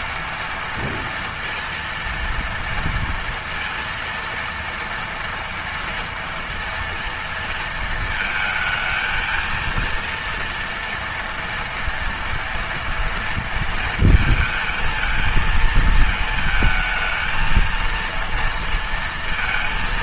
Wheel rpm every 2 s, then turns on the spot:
230, 230, 230, 230, 220, 230, 230, 230, 220, 230.
none